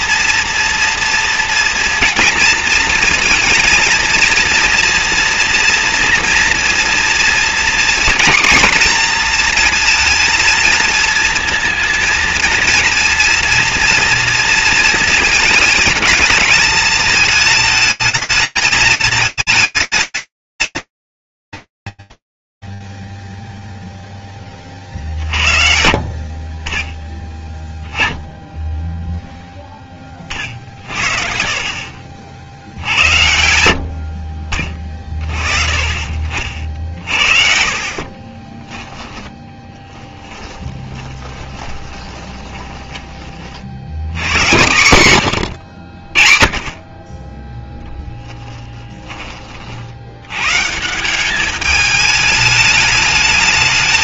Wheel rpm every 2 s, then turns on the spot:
230, 230, 230, 230, 250, 220, 230, 230, 220, 210, 150, 0, 30, 20, 0, 50, 80, 40, 50, 10, 20, 60, 90, 10, 30, 200, 220.
38-42